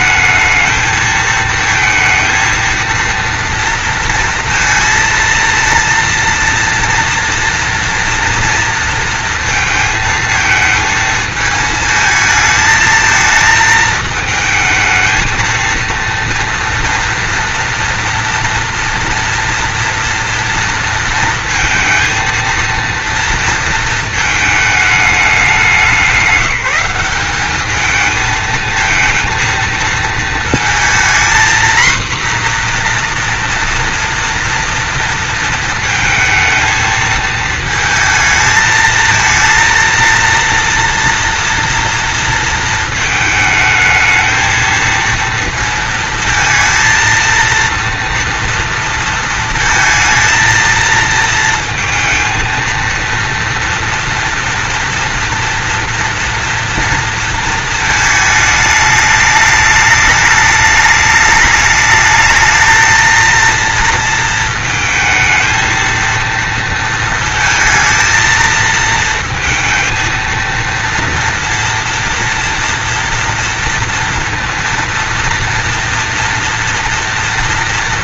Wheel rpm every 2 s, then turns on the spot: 220, 230, 230, 230, 240, 230, 220, 220, 230, 230, 230, 230, 220, 200, 220, 230, 240, 230, 220, 220, 230, 230, 220, 220, 230, 230, 230, 230, 230, 210, 210, 220, 220, 220, 220, 230, 230, 230, 230.
none